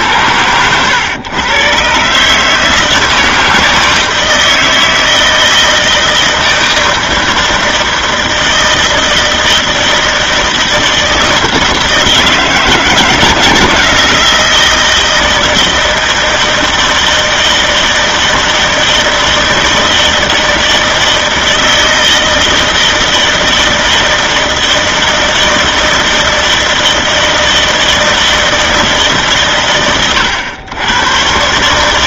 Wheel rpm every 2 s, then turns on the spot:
100, 150, 160, 160, 160, 160, 160, 160, 160, 160, 160, 160, 160, 160, 160, 100.
none